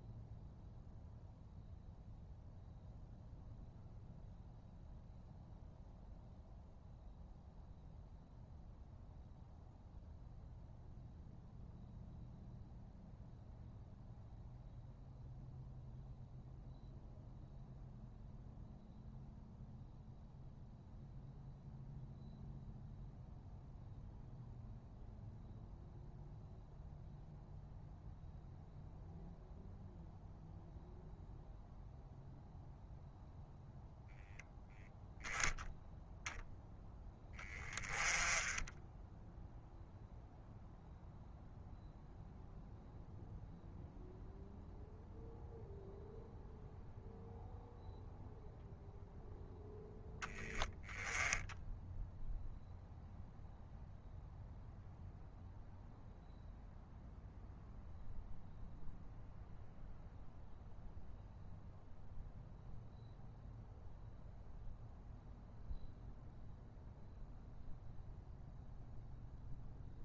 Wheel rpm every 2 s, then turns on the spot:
0, 0, 0, 0, 0, 0, 0, 0, 0, 0, 0, 0, 0, 0, 0, 0, 0, 0, 10, 10, 0, 0, 0, 0, 0, 0, 0, 0, 0, 0, 0, 0, 0, 0, 0.
none